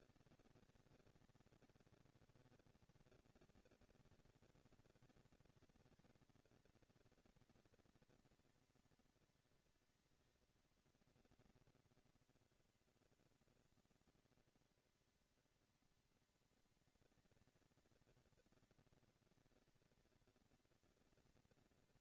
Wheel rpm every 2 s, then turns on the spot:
230, 240, 220, 230, 230, 230, 230, 240, 230, 230, 230.
none